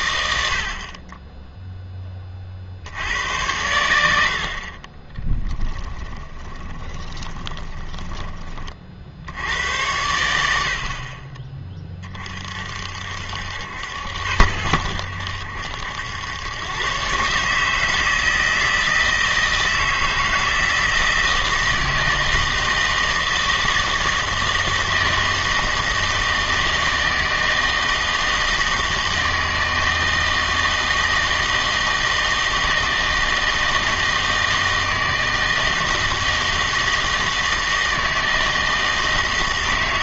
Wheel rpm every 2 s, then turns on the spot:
50, 70, 40, 20, 50, 60, 60, 80, 120, 160, 160, 160, 160, 160, 160, 160, 160, 160, 160, 160.
6-8